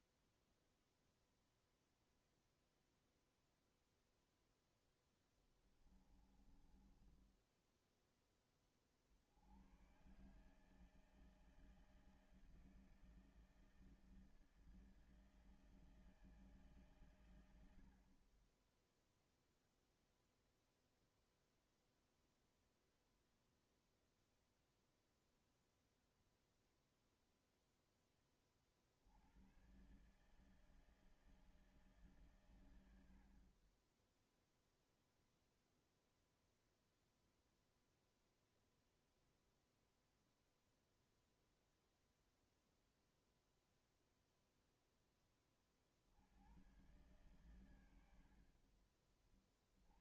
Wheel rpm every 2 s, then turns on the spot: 0, 0, 0, 20, 20, 140, 160, 160, 150, 30, 0, 0, 0, 0, 40, 150, 120, 0, 0, 0, 0, 0, 0, 90, 50.
6-8